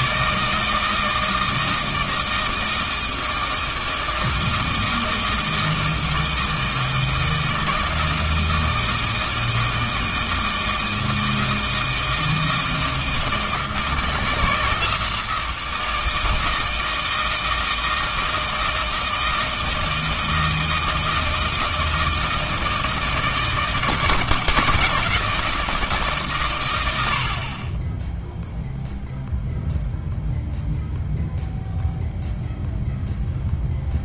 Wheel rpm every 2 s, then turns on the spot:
160, 160, 160, 160, 160, 160, 160, 160, 160, 160, 160, 160, 160, 90, 0, 0, 0.
none